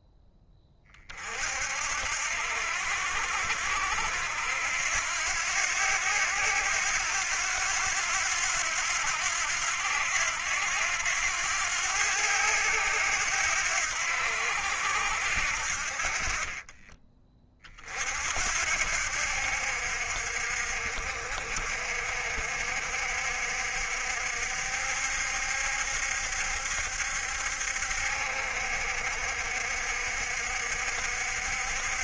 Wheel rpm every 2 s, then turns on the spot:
40, 70, 80, 90, 90, 90, 90, 80, 20, 70, 60, 60, 70, 70, 60, 60.
none